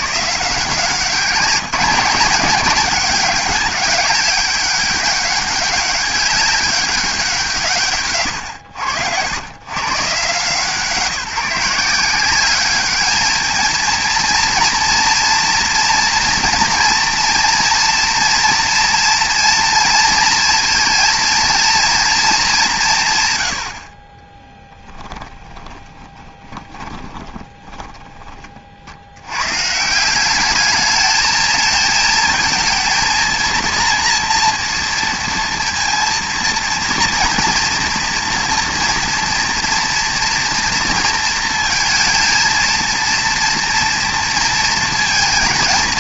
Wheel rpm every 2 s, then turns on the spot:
170, 200, 200, 200, 90, 170, 210, 230, 230, 230, 230, 150, 20, 20, 40, 210, 220, 230, 230, 230, 230, 230, 230.
24-28